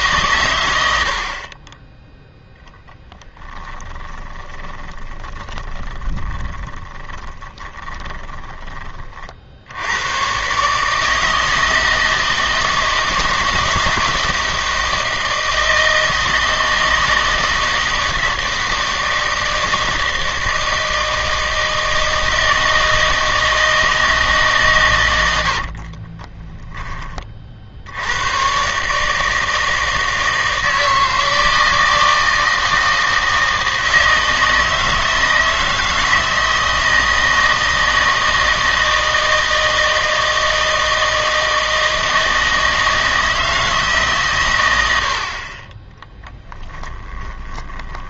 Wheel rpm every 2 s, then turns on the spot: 90, 10, 20, 10, 20, 150, 160, 160, 160, 160, 160, 160, 130, 20, 140, 160, 160, 160, 160, 160, 160, 160, 90, 10.
4-8 46-48